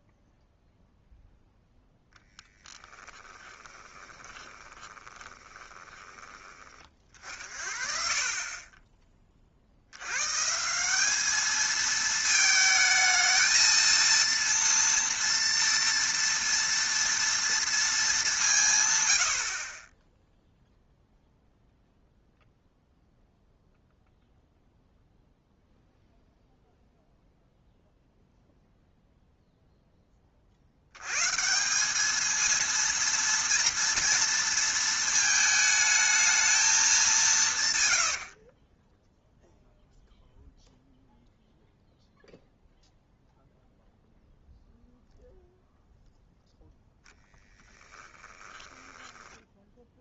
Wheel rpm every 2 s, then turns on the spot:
0, 10, 20, 20, 10, 180, 220, 230, 230, 140, 0, 0, 0, 0, 0, 100, 230, 230, 210, 30, 0, 0, 0, 10, 10.
2-6 38-40 48-50